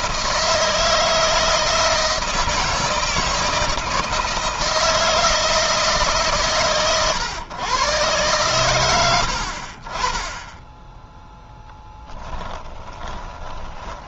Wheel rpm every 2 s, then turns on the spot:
160, 160, 160, 130, 110, 10, 20.
12-14